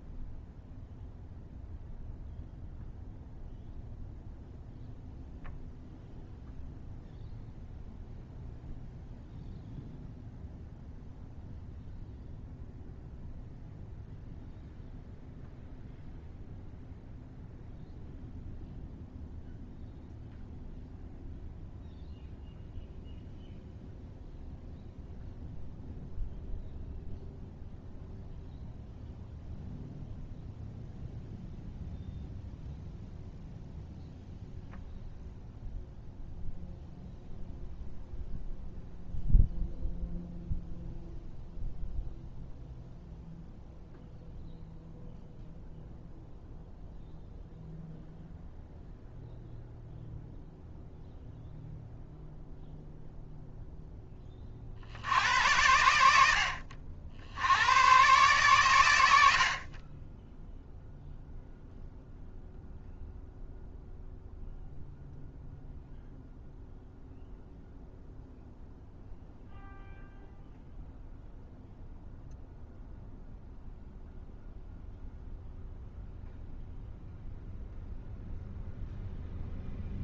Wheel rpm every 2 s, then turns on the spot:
0, 0, 0, 0, 0, 0, 0, 0, 0, 0, 0, 0, 0, 0, 0, 0, 0, 0, 0, 0, 0, 0, 0, 0, 0, 0, 0, 60, 70, 100, 0, 0, 0, 0, 0, 0, 0, 0, 0, 0.
none